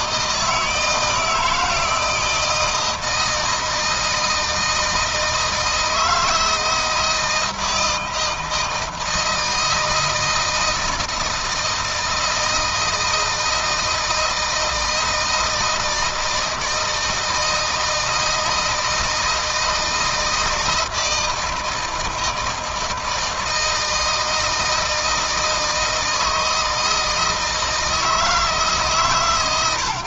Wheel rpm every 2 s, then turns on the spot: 160, 160, 160, 160, 160, 160, 160, 160, 160, 160, 160, 160, 160, 160, 150.
none